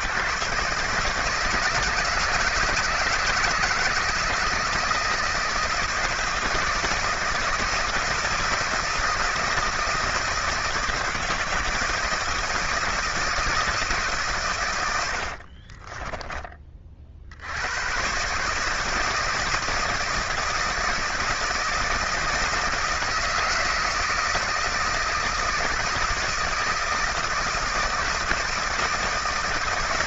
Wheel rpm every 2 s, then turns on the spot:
140, 160, 160, 160, 160, 160, 160, 120, 30, 150, 160, 160, 160, 160, 160.
none